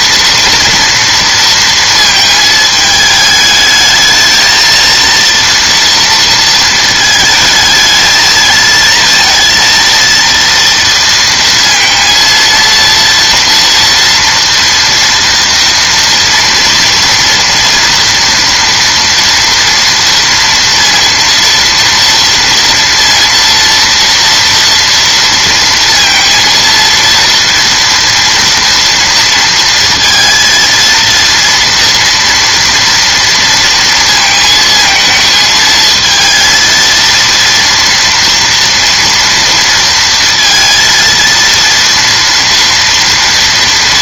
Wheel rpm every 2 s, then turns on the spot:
230, 220, 230, 230, 220, 230, 230, 230, 230, 230, 230, 230, 230, 230, 240, 230, 230, 220, 230, 230, 230, 230.
none